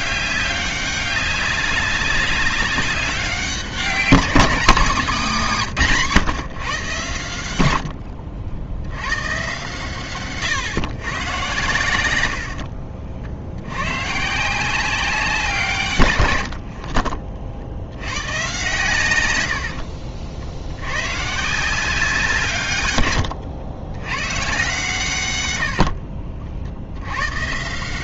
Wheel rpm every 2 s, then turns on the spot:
200, 190, 200, 130, 80, 140, 60, 170, 80, 120, 80, 140, 120, 60.
12-14 16-18